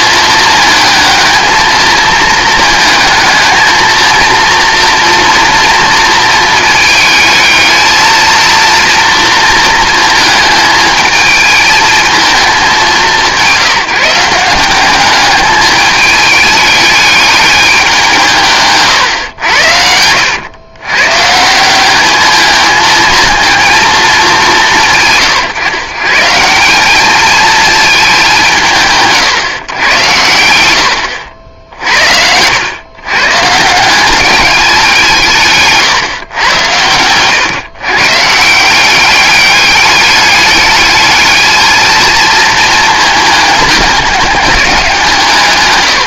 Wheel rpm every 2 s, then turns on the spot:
220, 220, 230, 220, 230, 220, 200, 190, 210, 140, 110, 220, 170, 190, 170, 90, 90, 190, 110, 170, 210, 220, 190.
none